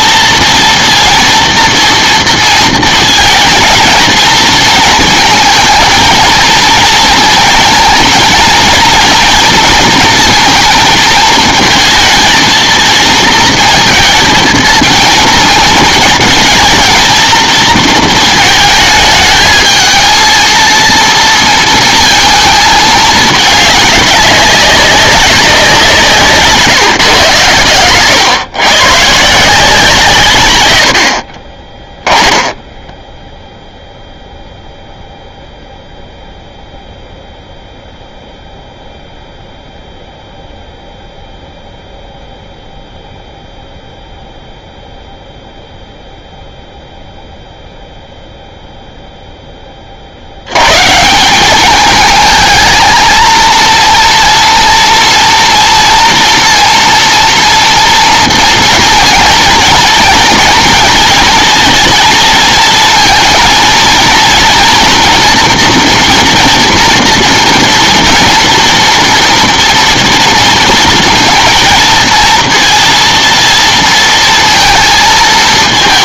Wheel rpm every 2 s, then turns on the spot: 230, 230, 220, 230, 230, 230, 230, 230, 220, 220, 230, 220, 200, 150, 130, 110, 10, 0, 0, 0, 0, 0, 0, 0, 0, 110, 220, 230, 230, 230, 230, 230, 230, 240, 230, 230, 230, 230.
32-34